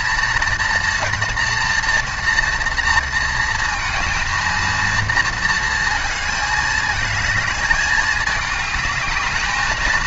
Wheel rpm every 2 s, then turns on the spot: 230, 230, 230, 220, 210.
none